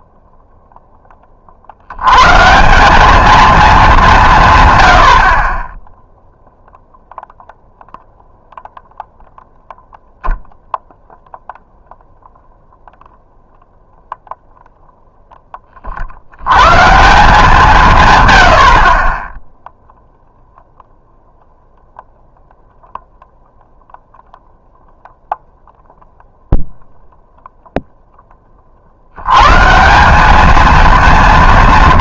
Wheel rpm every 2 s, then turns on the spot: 0, 170, 110, 0, 0, 0, 0, 0, 130, 60, 0, 0, 0, 0, 40, 220.
none